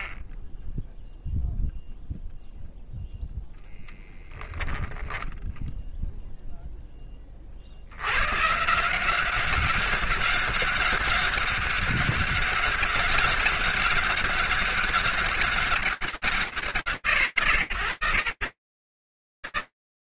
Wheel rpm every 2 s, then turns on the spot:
40, 0, 20, 0, 120, 200, 200, 200, 130, 120.
4-6